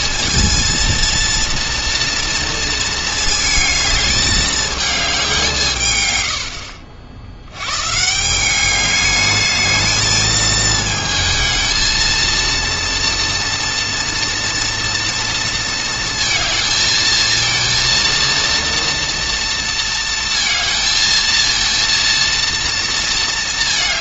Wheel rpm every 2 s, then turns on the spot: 230, 230, 210, 70, 210, 220, 230, 230, 220, 230, 230, 230.
none